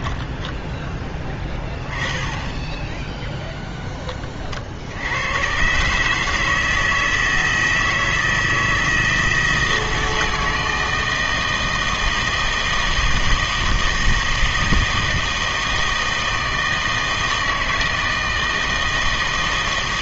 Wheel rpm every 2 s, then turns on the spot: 10, 20, 50, 160, 160, 160, 160, 160, 160, 160.
0-2